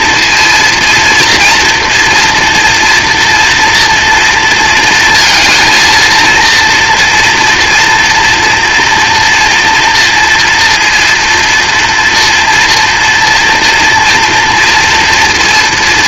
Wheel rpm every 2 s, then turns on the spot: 230, 240, 230, 230, 230, 230, 230, 230.
none